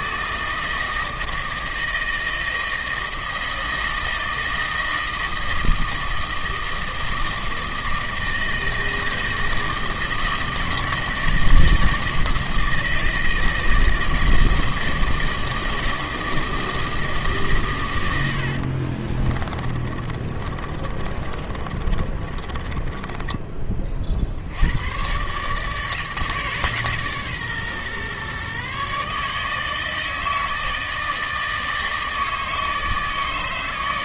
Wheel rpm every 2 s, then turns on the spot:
160, 160, 160, 160, 160, 160, 160, 160, 160, 50, 30, 20, 90, 150, 140, 160, 160.
18-24